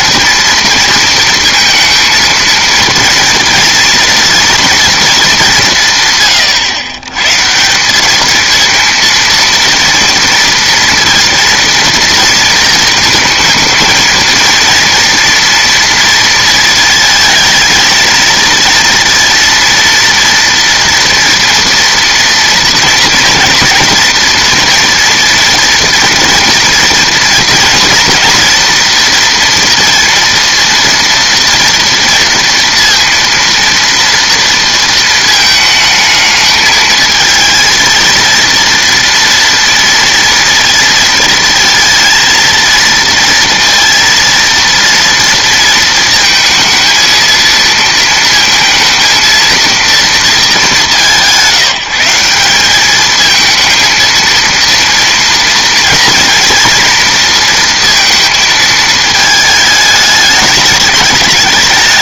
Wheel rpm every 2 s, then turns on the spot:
230, 230, 240, 110, 230, 230, 230, 230, 230, 230, 230, 230, 240, 230, 230, 230, 230, 230, 220, 230, 230, 230, 230, 230, 230, 200, 200, 230, 230, 220, 200.
none